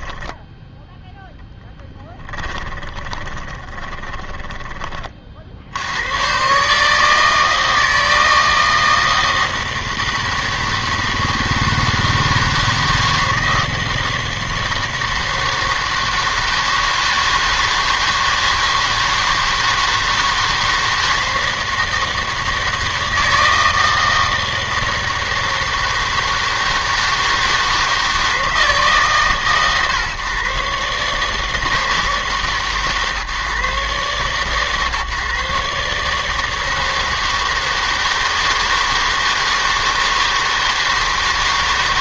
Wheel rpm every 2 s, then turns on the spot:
10, 20, 20, 130, 160, 160, 160, 160, 160, 160, 160, 160, 160, 160, 160, 140, 150, 140, 160, 160, 160.
2-6